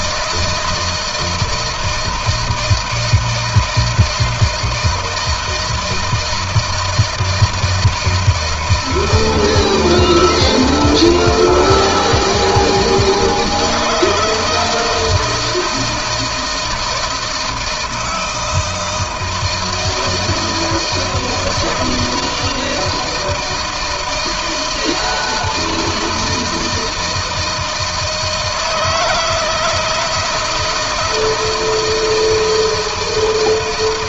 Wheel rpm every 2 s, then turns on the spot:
160, 160, 170, 160, 160, 160, 160, 160, 160, 170, 160, 160, 160, 160, 160, 160, 160.
none